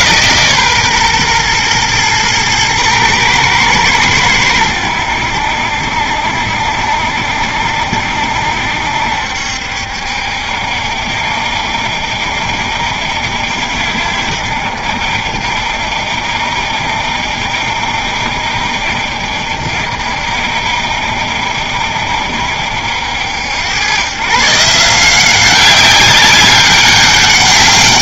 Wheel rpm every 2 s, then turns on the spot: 130, 110, 90, 70, 70, 70, 70, 60, 70, 60, 70, 70, 160, 200.
none